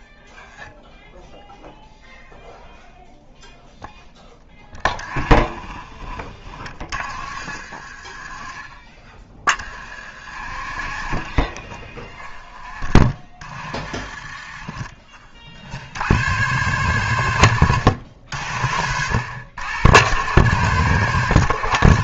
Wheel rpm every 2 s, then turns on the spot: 0, 0, 10, 30, 30, 40, 20, 20, 110, 70, 120.
none